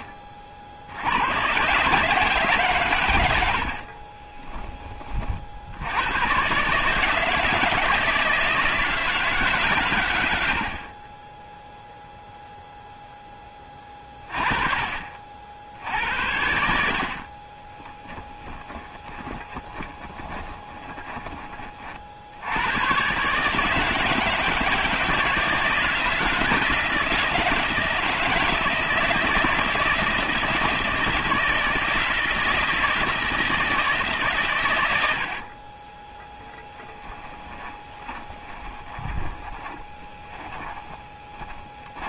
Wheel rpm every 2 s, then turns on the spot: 60, 150, 20, 120, 160, 80, 0, 30, 80, 20, 20, 90, 160, 170, 160, 160, 170, 130, 10, 20, 20.
18-22 36-42